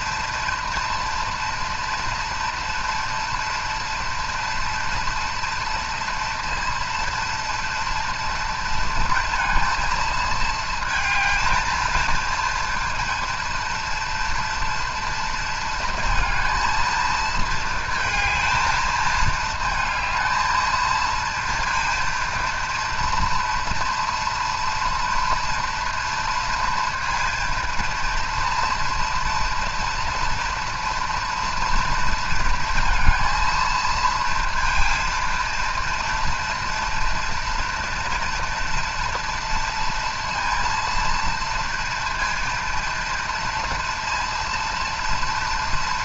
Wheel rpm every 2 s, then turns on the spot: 230, 230, 230, 240, 230, 220, 230, 240, 230, 220, 220, 230, 230, 230, 230, 230, 230, 230, 230, 230, 230, 230, 230.
none